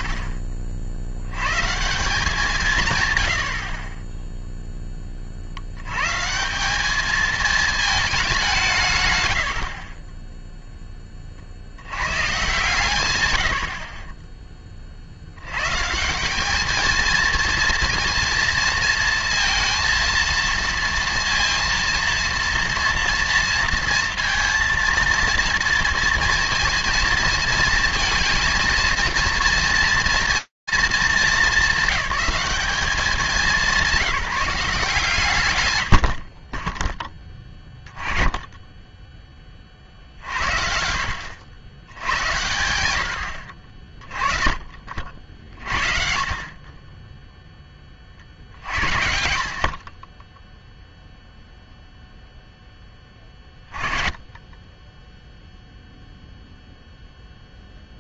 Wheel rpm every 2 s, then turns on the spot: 20, 170, 10, 150, 200, 10, 120, 30, 200, 230, 230, 230, 230, 230, 220, 230, 210, 160, 10, 40, 100, 70, 50, 20, 40, 0, 20, 0, 0.
10-12 48-50